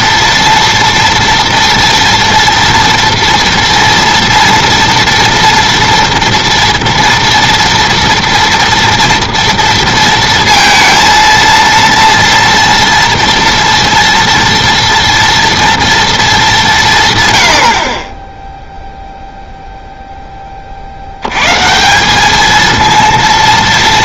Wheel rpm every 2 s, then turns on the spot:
230, 230, 230, 230, 230, 230, 230, 230, 180, 0, 30, 220.
none